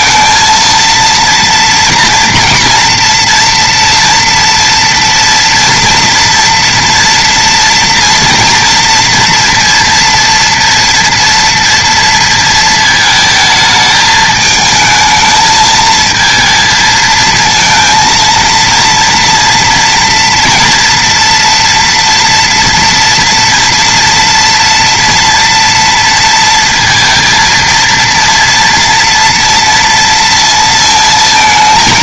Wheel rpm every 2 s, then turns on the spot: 230, 230, 230, 240, 230, 230, 230, 220, 220, 230, 230, 230, 230, 230, 230, 230.
none